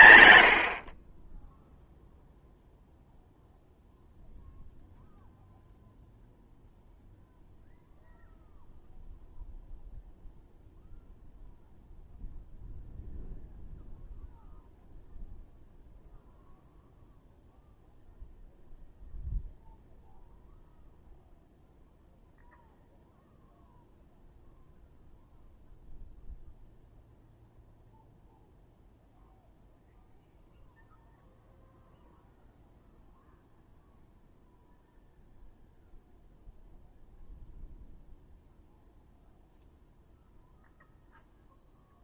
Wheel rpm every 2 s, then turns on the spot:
30, 0, 0, 0, 0, 0, 0, 0, 0, 0, 0, 0, 0, 0, 0, 0, 0, 0, 0, 0, 0.
none